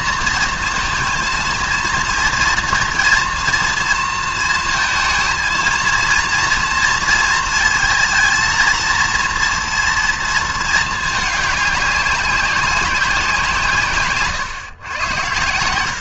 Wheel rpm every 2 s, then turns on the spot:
230, 230, 230, 230, 230, 220, 190, 120.
none